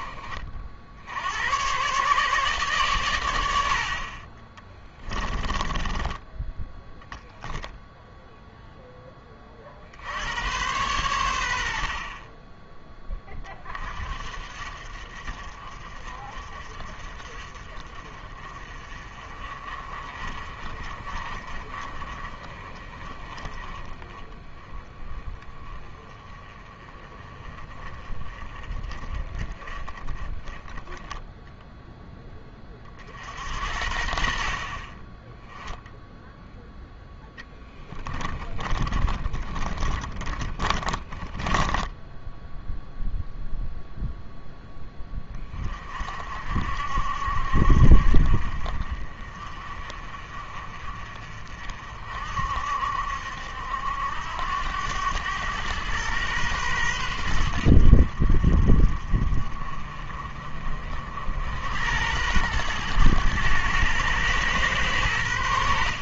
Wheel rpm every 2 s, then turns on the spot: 60, 130, 20, 0, 10, 110, 20, 50, 40, 40, 40, 30, 20, 20, 30, 10, 30, 40, 10, 30, 20, 0, 10, 60, 50, 40, 70, 90, 110, 40, 50, 110, 110.
4-6 38-42